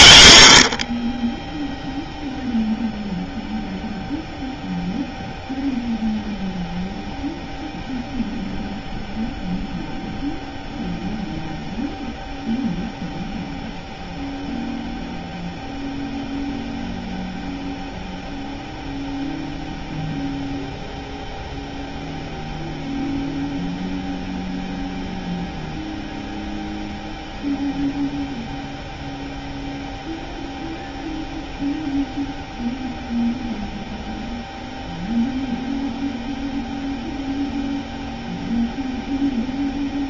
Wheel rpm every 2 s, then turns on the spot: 50, 0, 0, 0, 0, 0, 0, 0, 0, 0, 0, 0, 0, 0, 0, 0, 0, 0, 0, 0.
none